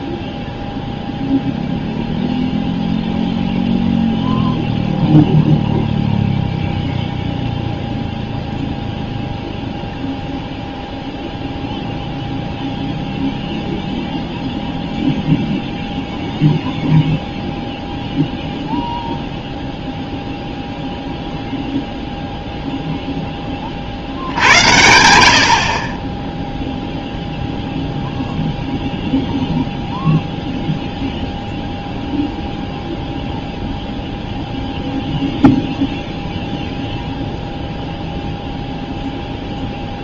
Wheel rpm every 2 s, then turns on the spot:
0, 0, 0, 0, 0, 0, 0, 0, 0, 0, 0, 0, 90, 0, 0, 0, 0, 0, 0, 0.
24-26